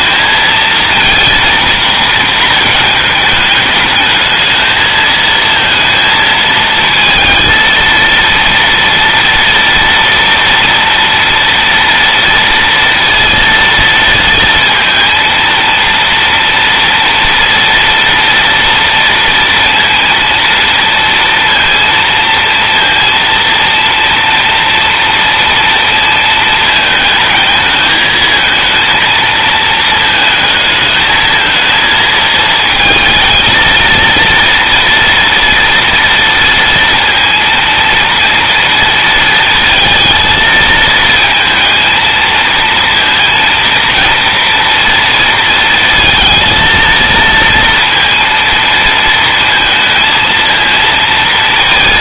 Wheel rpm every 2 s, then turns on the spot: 230, 220, 220, 230, 230, 230, 230, 230, 230, 230, 230, 230, 230, 220, 230, 220, 230, 230, 230, 230, 220, 230, 230, 230, 230, 230.
none